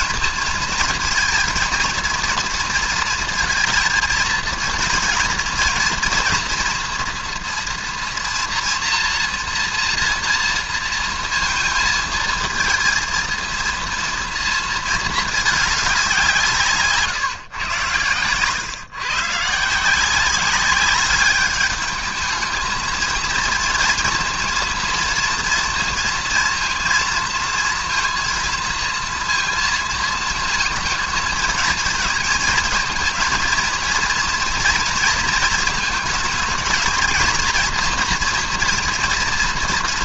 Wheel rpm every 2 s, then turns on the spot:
220, 230, 230, 240, 230, 230, 220, 230, 160, 120, 190, 220, 230, 230, 230, 220, 220, 230, 230, 240.
none